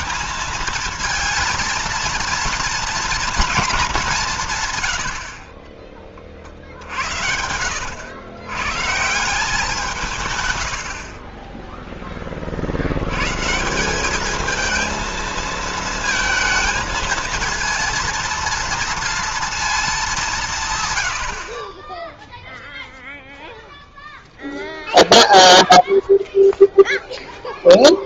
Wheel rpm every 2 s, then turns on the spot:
220, 230, 160, 40, 120, 120, 40, 220, 220, 230, 150, 0, 0, 0.
6-8